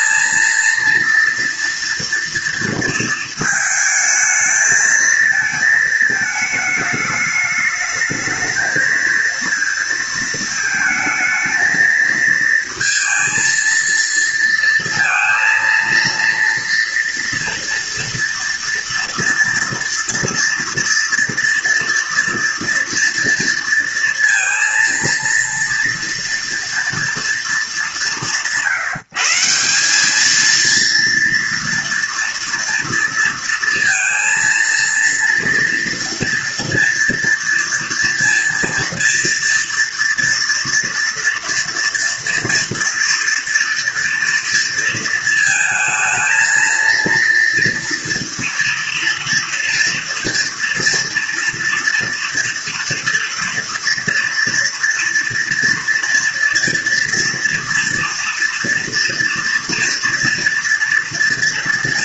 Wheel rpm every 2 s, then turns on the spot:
230, 230, 220, 220, 220, 220, 230, 230, 230, 230, 230, 230, 230, 230, 160, 230, 230, 230, 230, 230, 230, 230, 230, 230, 230, 240, 230, 230, 230, 230, 240.
none